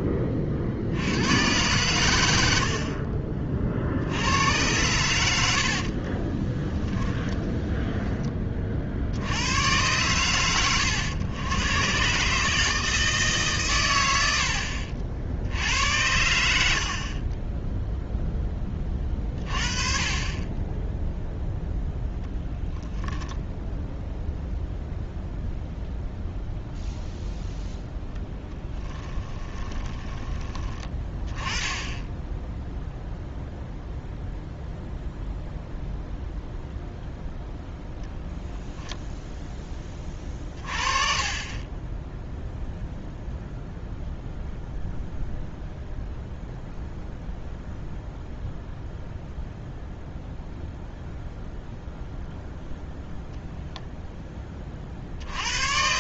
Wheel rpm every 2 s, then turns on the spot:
40, 60, 100, 10, 40, 110, 160, 60, 50, 20, 10, 0, 0, 0, 10, 20, 0, 0, 0, 0, 30, 0, 0, 0, 0, 0, 0, 30.
2-4 6-8 28-30